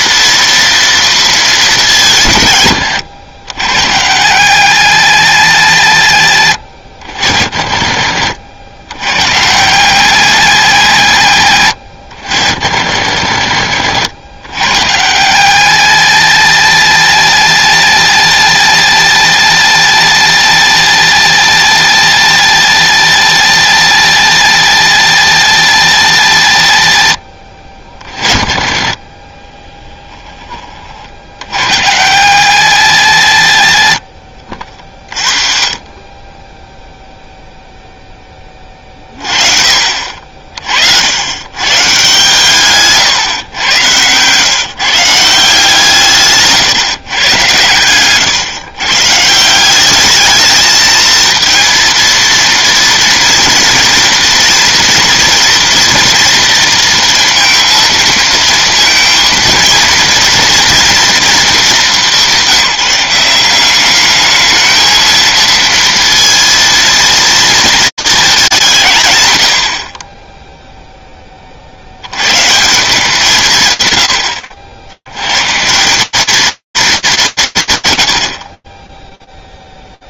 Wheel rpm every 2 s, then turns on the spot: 230, 130, 110, 80, 70, 160, 70, 80, 120, 120, 110, 120, 120, 90, 30, 20, 110, 50, 10, 20, 50, 150, 140, 150, 130, 220, 230, 230, 230, 230, 230, 190, 220, 230, 200, 10, 150, 100, 210, 30.
6-8 34-36